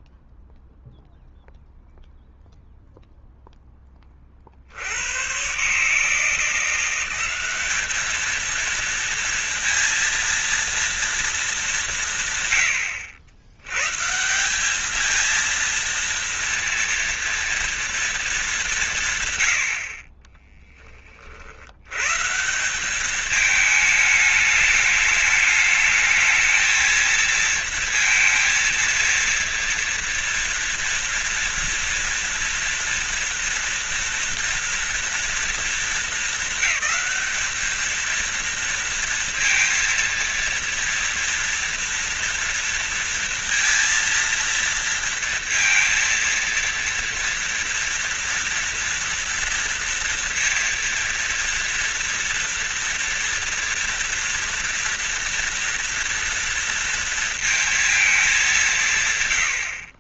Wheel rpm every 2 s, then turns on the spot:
0, 0, 70, 180, 230, 230, 120, 200, 230, 180, 20, 190, 210, 220, 230, 230, 230, 230, 220, 230, 230, 230, 230, 230, 230, 230, 230, 230, 230, 180.
none